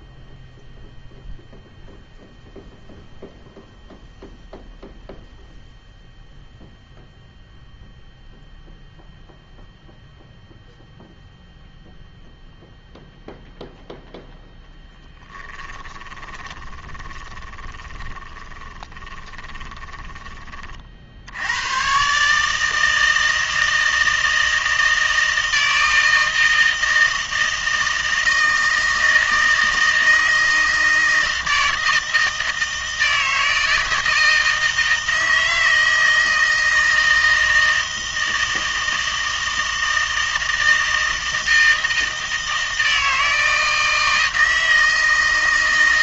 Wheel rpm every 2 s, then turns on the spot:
0, 0, 0, 0, 0, 0, 0, 0, 20, 20, 30, 150, 160, 160, 160, 160, 160, 160, 160, 160, 160, 160, 160.
16-20